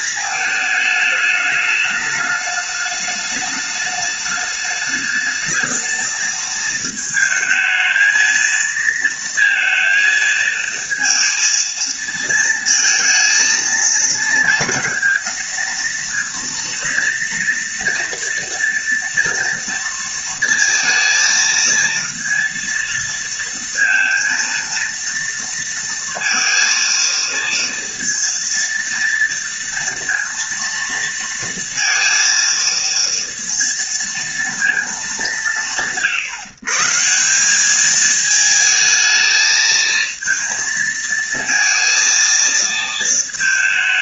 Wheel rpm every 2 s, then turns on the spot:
220, 210, 210, 220, 230, 230, 220, 230, 230, 230, 230, 230, 230, 230, 230, 230, 230, 200, 140, 220, 230, 220.
none